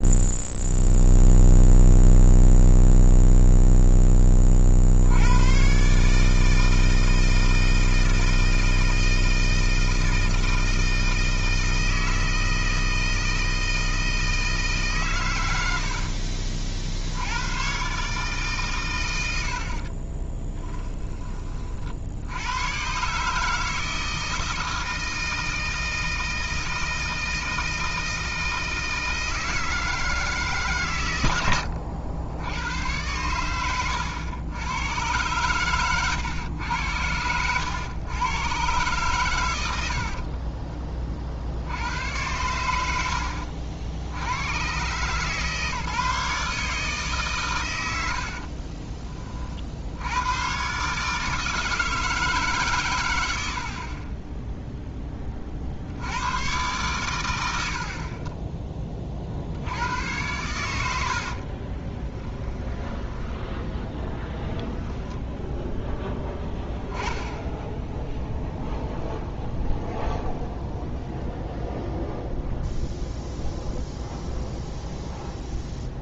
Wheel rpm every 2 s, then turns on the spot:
0, 0, 60, 160, 160, 160, 160, 150, 60, 110, 10, 130, 160, 160, 160, 130, 100, 110, 100, 120, 30, 80, 130, 150, 30, 140, 120, 20, 130, 20, 90, 10, 0, 0, 0, 0, 0, 0.
48-50